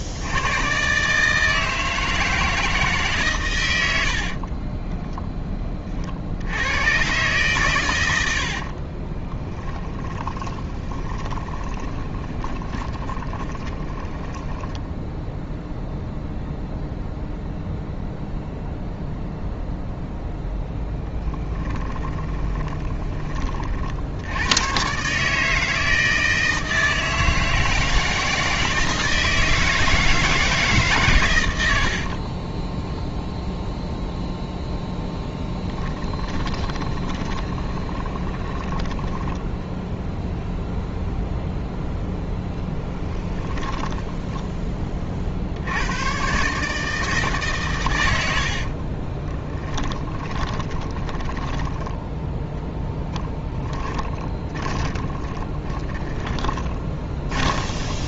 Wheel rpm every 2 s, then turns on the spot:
130, 160, 20, 110, 50, 20, 20, 0, 0, 0, 10, 20, 120, 160, 160, 140, 0, 0, 20, 20, 0, 10, 20, 150, 30, 20, 0, 20, 20.
4-6 8-14 20-24 36-38 42-44 48-52 54-58